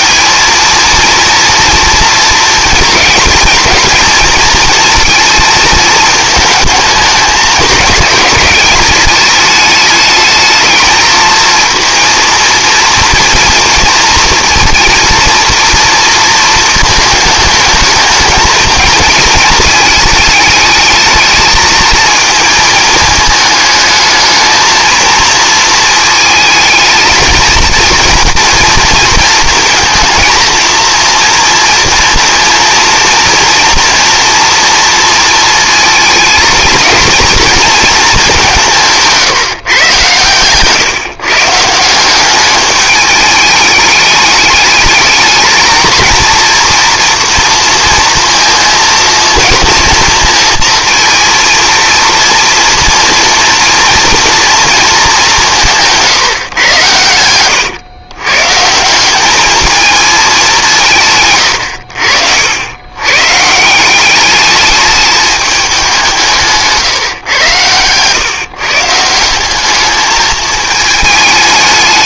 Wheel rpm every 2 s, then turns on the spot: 230, 230, 230, 220, 210, 220, 230, 230, 220, 220, 220, 220, 230, 220, 230, 230, 230, 230, 230, 160, 150, 210, 210, 230, 230, 230, 230, 220, 110, 170, 150, 110, 210, 140, 150, 220.
none